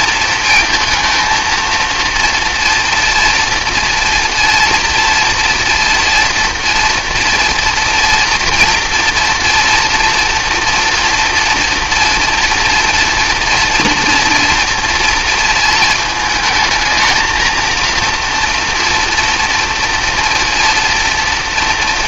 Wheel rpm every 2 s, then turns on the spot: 230, 230, 230, 230, 240, 230, 240, 230, 220, 230, 230.
none